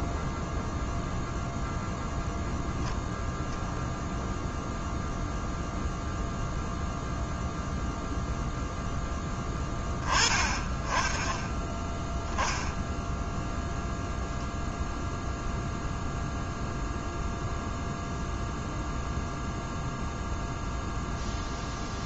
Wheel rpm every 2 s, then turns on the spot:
0, 0, 0, 0, 0, 20, 10, 0, 0, 0, 0.
none